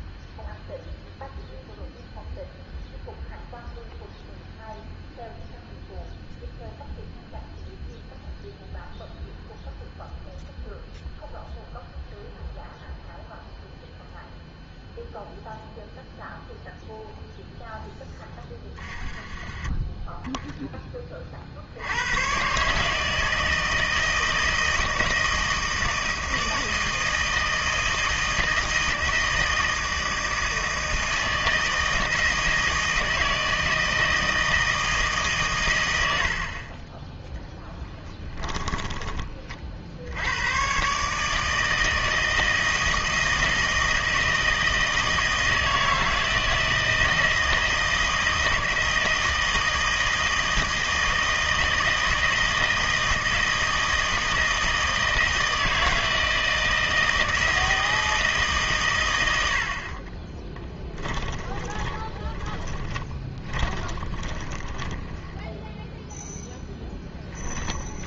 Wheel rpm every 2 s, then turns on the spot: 0, 0, 0, 0, 0, 0, 0, 0, 0, 30, 10, 140, 160, 160, 160, 160, 160, 160, 40, 10, 110, 160, 160, 160, 160, 160, 160, 160, 160, 140, 10, 20, 20, 10.
18-20 38-40 60-66